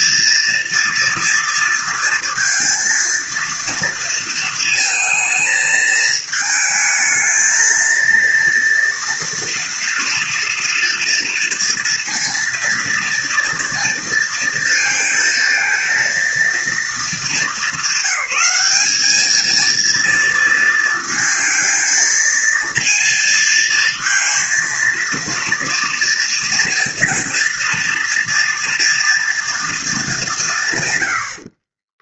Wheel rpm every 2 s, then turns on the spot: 230, 230, 230, 220, 230, 230, 230, 230, 210, 220, 230, 230, 230, 230, 230, 80.
none